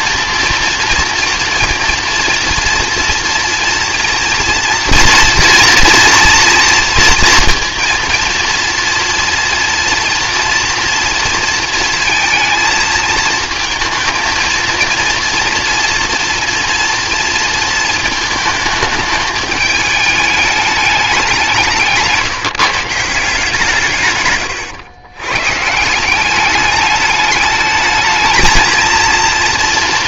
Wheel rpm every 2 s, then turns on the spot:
230, 240, 230, 230, 230, 230, 230, 230, 230, 210, 210, 150, 120, 210, 230.
none